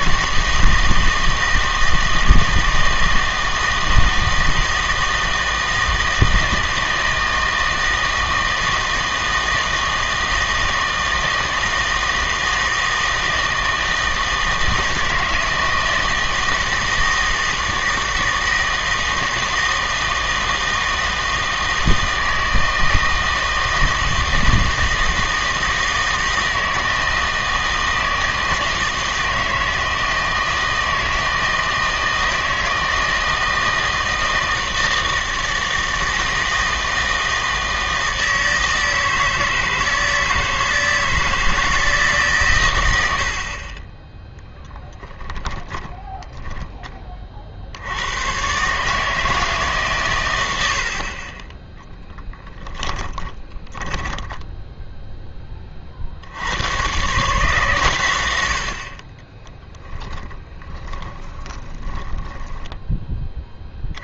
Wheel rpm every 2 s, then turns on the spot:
160, 160, 160, 160, 160, 160, 160, 160, 160, 160, 160, 160, 160, 160, 160, 160, 160, 160, 160, 160, 160, 110, 10, 30, 140, 80, 10, 20, 100, 70, 20, 20.
44-48 52-56 60-64